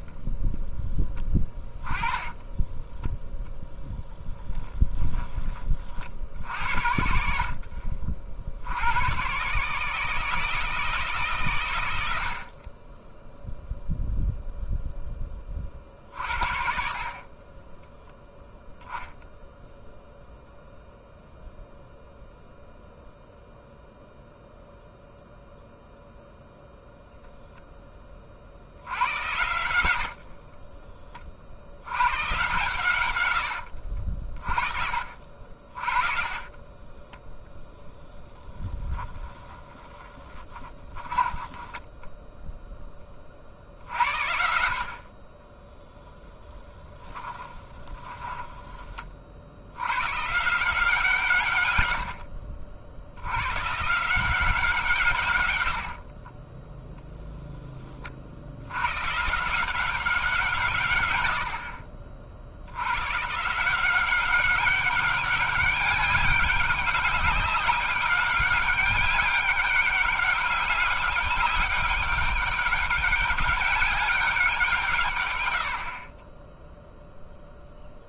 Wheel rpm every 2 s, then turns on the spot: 10, 10, 10, 70, 80, 160, 20, 0, 50, 0, 0, 0, 0, 0, 80, 30, 130, 50, 10, 10, 20, 10, 50, 10, 20, 160, 70, 150, 10, 110, 130, 100, 190, 190, 200, 200, 190, 150, 0.
2-6 36-42 46-48 56-58